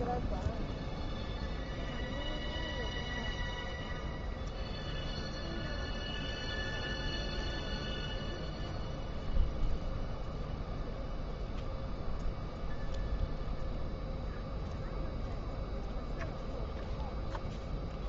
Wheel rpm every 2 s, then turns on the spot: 0, 0, 0, 0, 0, 0, 0, 0, 0.
none